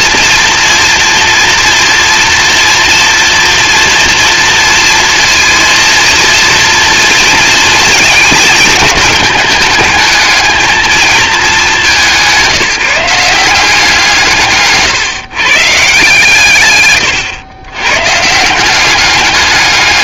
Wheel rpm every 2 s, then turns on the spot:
230, 230, 230, 230, 220, 220, 180, 150, 130, 180.
none